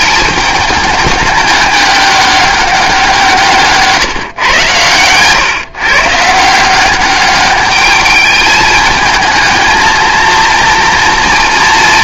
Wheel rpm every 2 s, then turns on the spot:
210, 190, 120, 180, 220, 230.
none